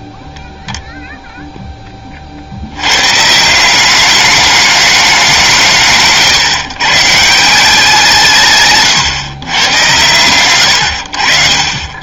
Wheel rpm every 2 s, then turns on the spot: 0, 80, 210, 140, 150, 100.
none